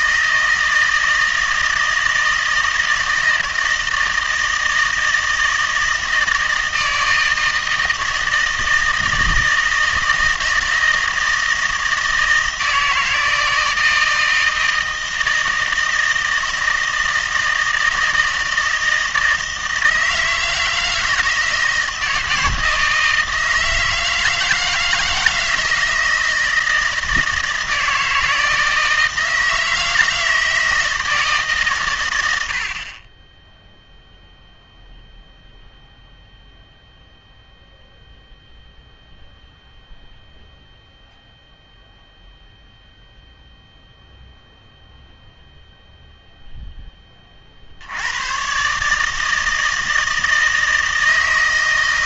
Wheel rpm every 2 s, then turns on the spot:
160, 160, 160, 160, 160, 160, 160, 170, 160, 160, 160, 160, 160, 160, 160, 160, 50, 0, 0, 0, 0, 0, 0, 10, 140, 160.
none